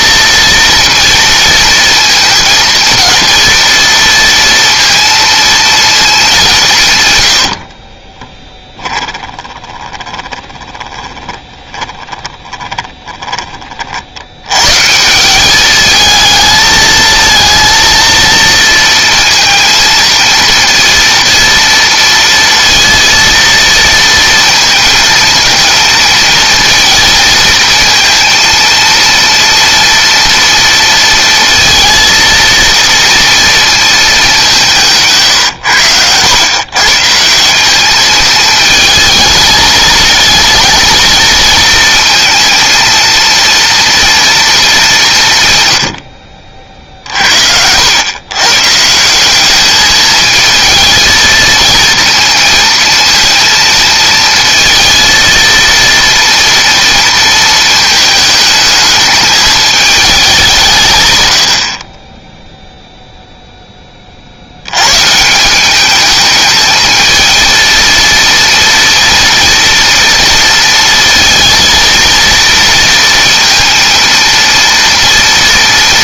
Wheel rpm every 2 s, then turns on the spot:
230, 230, 230, 140, 10, 20, 20, 160, 220, 230, 230, 230, 230, 230, 230, 230, 230, 160, 150, 220, 230, 230, 180, 60, 180, 230, 230, 230, 230, 220, 140, 0, 140, 220, 230, 230, 230, 230.
6-14